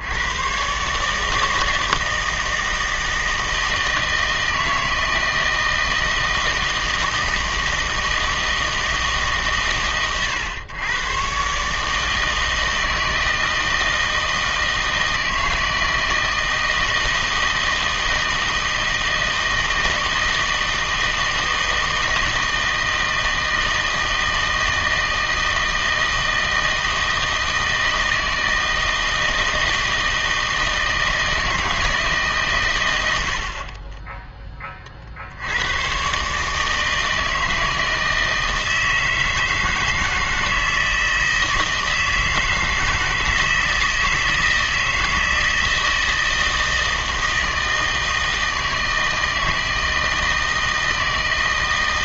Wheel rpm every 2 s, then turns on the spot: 130, 160, 160, 160, 160, 120, 160, 160, 160, 160, 160, 160, 160, 160, 160, 160, 120, 20, 150, 160, 160, 160, 160, 160, 160, 160.
none